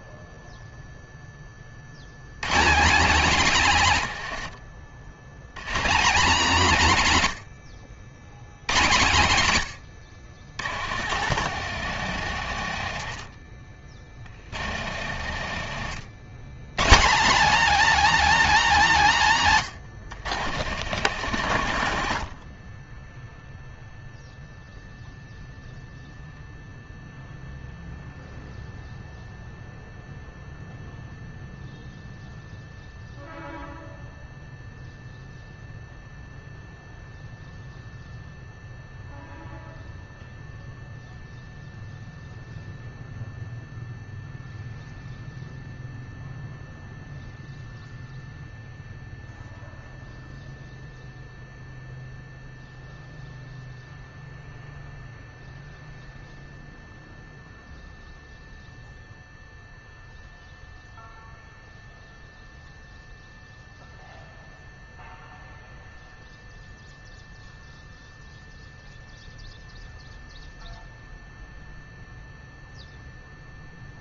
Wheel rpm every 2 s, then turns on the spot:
10, 210, 90, 130, 110, 120, 50, 100, 250, 160, 80, 0, 20, 0, 0, 0, 0, 0, 0, 0, 0, 0, 0, 0, 0, 0, 0, 0, 0, 0, 0, 0, 0, 0, 0, 0, 0.
10-16 20-22